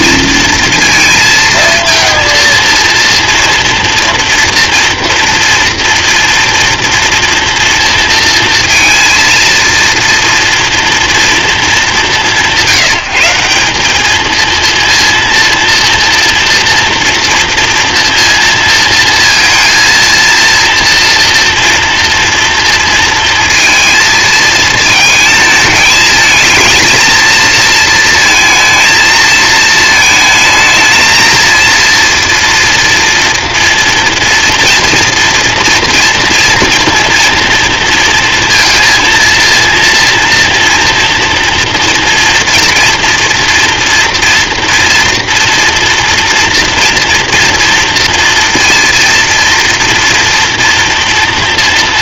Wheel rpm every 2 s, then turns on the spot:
230, 230, 240, 230, 230, 230, 180, 230, 230, 230, 230, 230, 220, 230, 230, 220, 230, 230, 230, 230, 230, 230, 230, 230, 230, 230.
none